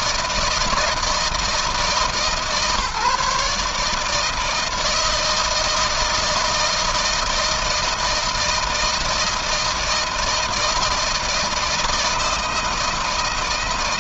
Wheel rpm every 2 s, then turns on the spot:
160, 150, 160, 160, 160, 160, 160.
none